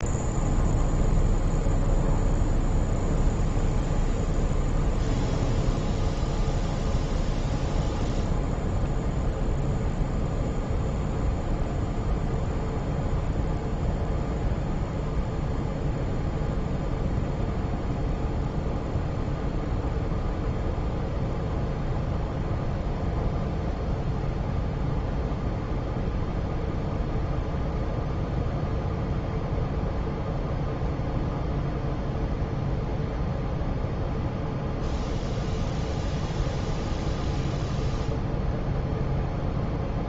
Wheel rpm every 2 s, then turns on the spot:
0, 0, 0, 0, 0, 0, 0, 0, 0, 0, 0, 0, 0, 0, 0, 0, 0, 0, 0, 0.
none